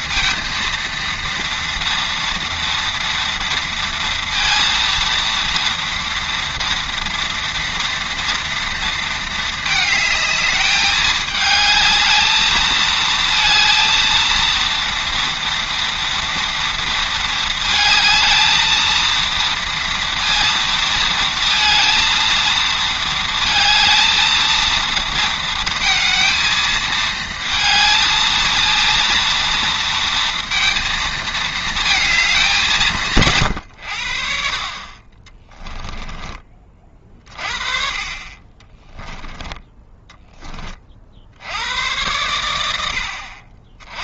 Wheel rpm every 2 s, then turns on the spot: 230, 230, 230, 230, 230, 210, 220, 230, 230, 220, 230, 230, 230, 220, 230, 230, 170, 30, 40, 20, 40, 90.
38-40